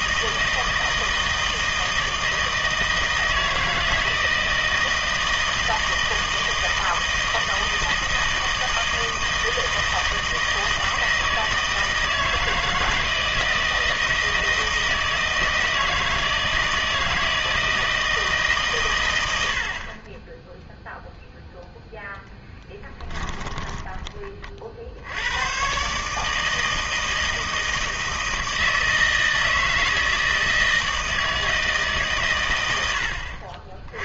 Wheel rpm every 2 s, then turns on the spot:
160, 160, 160, 160, 160, 160, 160, 160, 160, 130, 0, 10, 40, 160, 160, 160, 100.
22-24